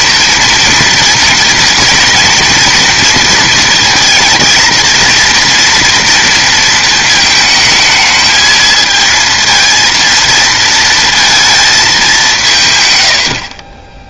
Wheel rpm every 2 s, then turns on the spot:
230, 230, 230, 230, 220, 230, 140.
none